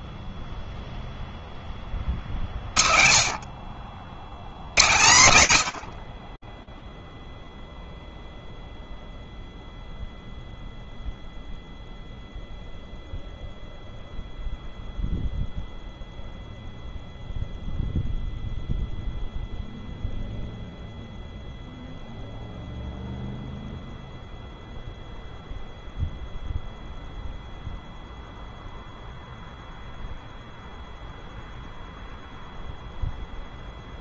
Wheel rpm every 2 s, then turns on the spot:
10, 40, 90, 0, 0, 0, 0, 0, 0, 0, 0, 0, 0, 0, 0, 0, 0.
none